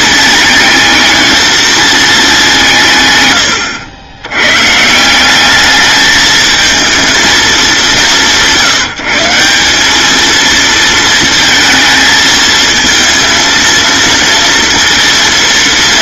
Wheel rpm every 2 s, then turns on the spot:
220, 120, 170, 220, 170, 220, 230, 230.
none